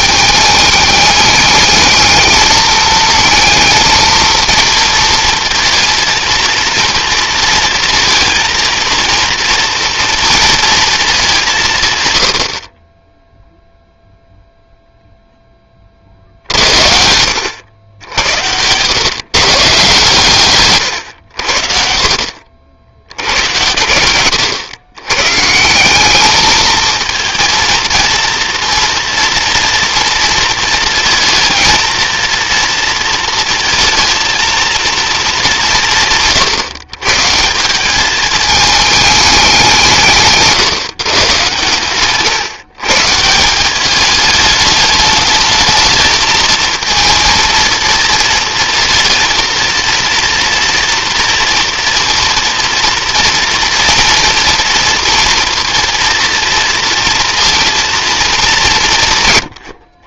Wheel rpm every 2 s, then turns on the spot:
210, 220, 230, 230, 230, 220, 30, 0, 80, 120, 110, 80, 110, 220, 230, 230, 230, 230, 150, 210, 140, 140, 210, 220, 230, 230, 230, 240, 230, 170.
none